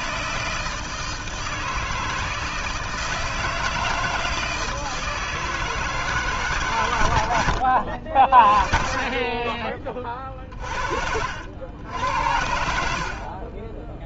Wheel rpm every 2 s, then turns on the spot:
160, 160, 160, 140, 40, 40, 70.
10-12